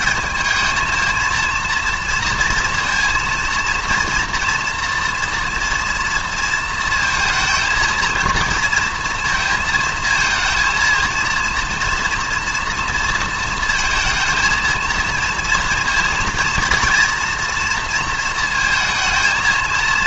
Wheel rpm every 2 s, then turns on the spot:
220, 230, 240, 230, 230, 230, 230, 230, 230, 230.
none